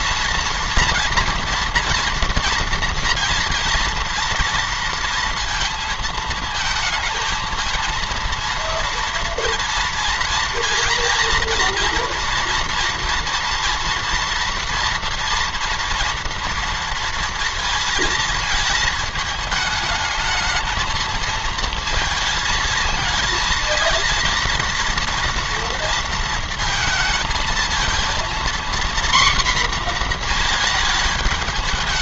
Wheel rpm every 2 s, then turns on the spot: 230, 230, 230, 230, 230, 240, 240, 230, 230, 220, 220, 220, 230, 230, 240, 220.
none